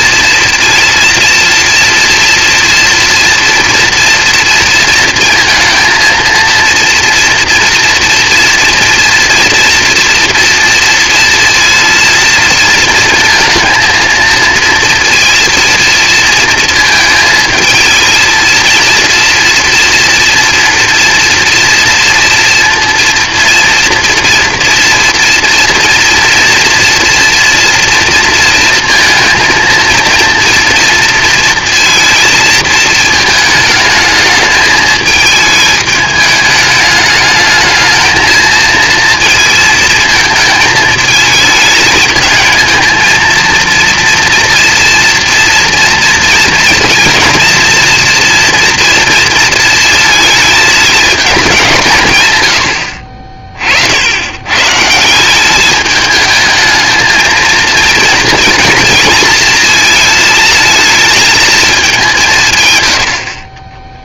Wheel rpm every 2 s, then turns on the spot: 240, 230, 230, 230, 230, 230, 230, 230, 220, 230, 230, 230, 240, 230, 230, 230, 220, 210, 210, 230, 220, 230, 230, 230, 230, 200, 40, 180, 220, 230, 220, 60.
none